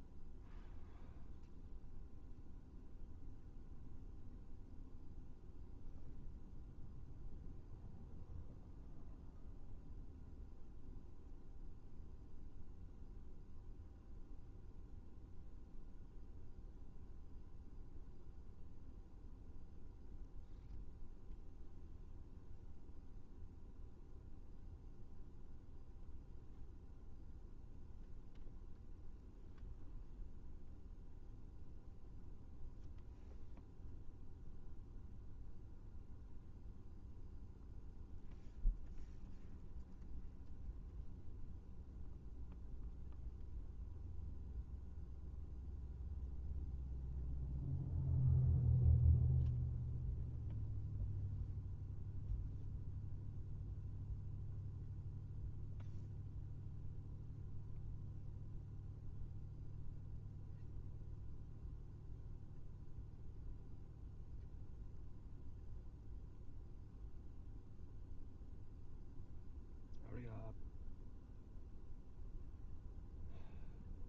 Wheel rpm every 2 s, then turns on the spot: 0, 0, 0, 0, 0, 0, 0, 0, 0, 0, 0, 0, 0, 0, 0, 0, 0, 0, 0, 0, 0, 0, 0, 0, 0, 0, 0, 0, 0, 0, 0, 0, 0, 0, 0, 0, 0.
none